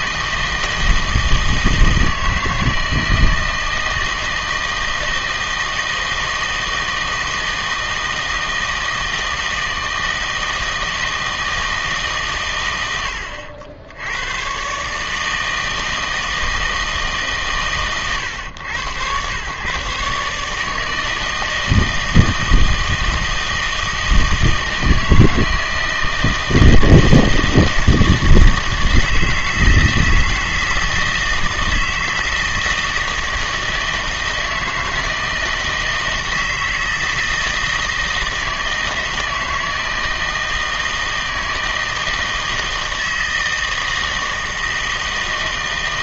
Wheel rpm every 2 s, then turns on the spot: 160, 160, 160, 160, 160, 160, 90, 140, 160, 110, 160, 160, 160, 160, 160, 160, 160, 160, 160, 160, 160, 160, 160.
none